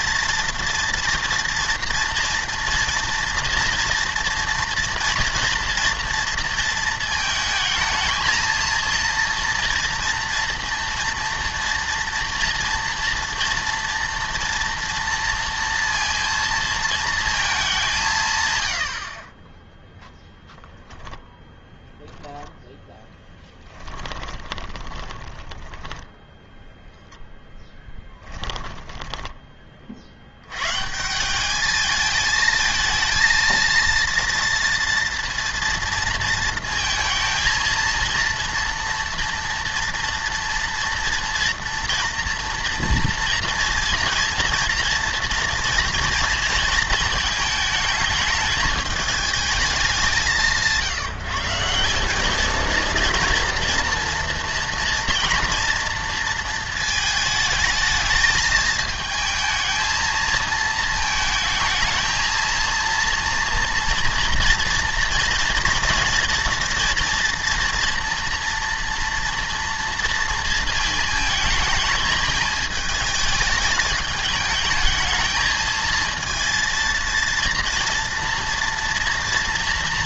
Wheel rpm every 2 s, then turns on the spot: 230, 230, 230, 230, 230, 230, 230, 230, 230, 90, 0, 10, 20, 10, 10, 130, 220, 230, 220, 230, 230, 230, 230, 230, 210, 170, 230, 230, 220, 220, 220, 230, 230, 240, 230, 230, 220, 220, 230, 230.
22-26 28-30